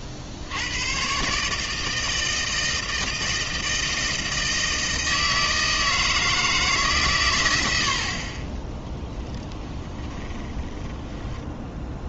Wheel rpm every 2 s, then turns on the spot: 80, 160, 160, 160, 30, 20.
10-12